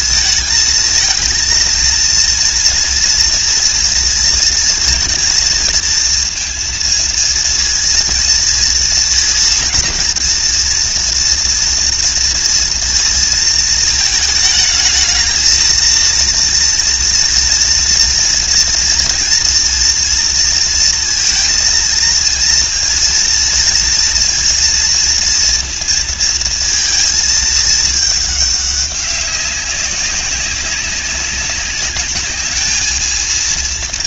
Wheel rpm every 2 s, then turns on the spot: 230, 230, 230, 230, 230, 230, 230, 220, 230, 230, 230, 230, 230, 220, 200, 190, 220.
none